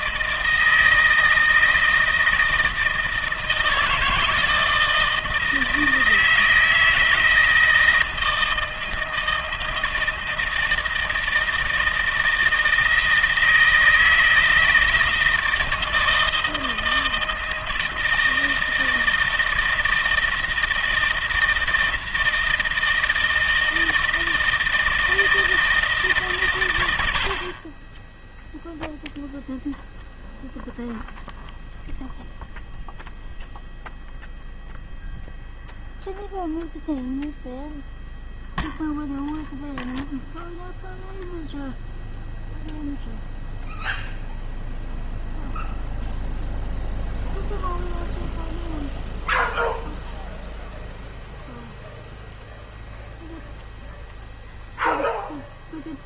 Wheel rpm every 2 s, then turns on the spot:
160, 160, 160, 160, 160, 160, 160, 160, 160, 160, 160, 160, 160, 110, 0, 0, 0, 0, 0, 0, 0, 0, 0, 0, 0, 0, 0, 0.
none